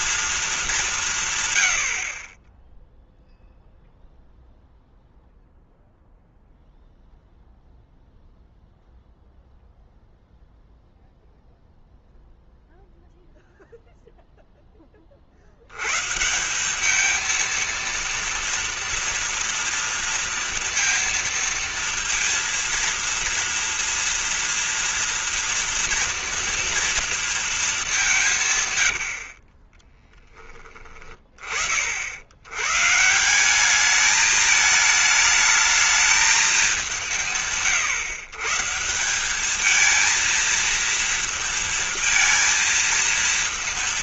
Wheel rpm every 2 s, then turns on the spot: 210, 20, 0, 0, 0, 0, 0, 10, 190, 230, 230, 230, 230, 230, 130, 30, 120, 220, 200, 160, 230, 230.
28-30